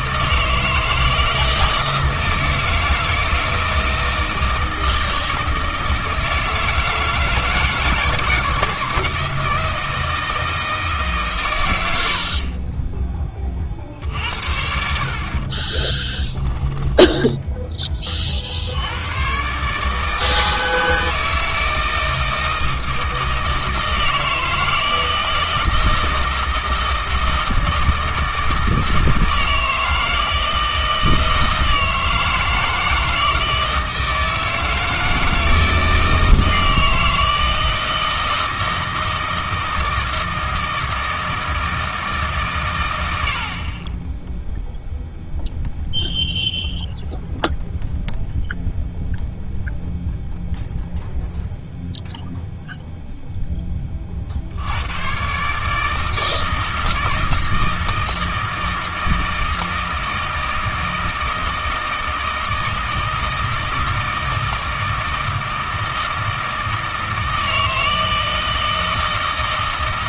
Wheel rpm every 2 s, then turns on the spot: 160, 160, 160, 160, 160, 160, 30, 70, 10, 80, 160, 160, 160, 160, 160, 160, 160, 160, 160, 160, 160, 130, 0, 0, 0, 0, 0, 90, 160, 160, 160, 160, 160, 160, 160.
16-18